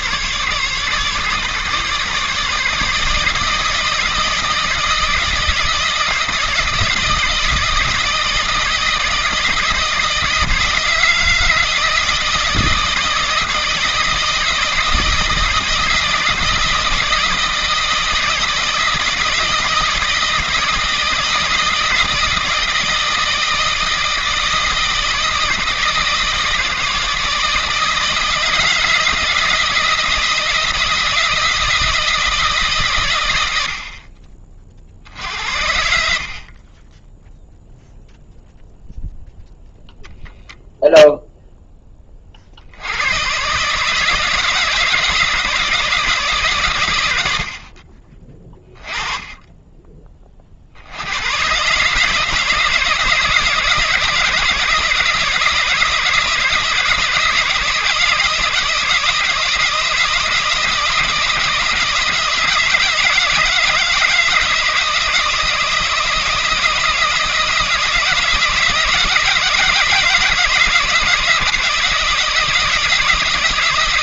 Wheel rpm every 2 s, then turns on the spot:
150, 160, 160, 160, 160, 160, 160, 160, 160, 160, 160, 170, 160, 160, 160, 170, 120, 60, 10, 0, 0, 90, 160, 100, 20, 90, 160, 160, 160, 160, 170, 160, 160, 170, 170, 160, 160.
none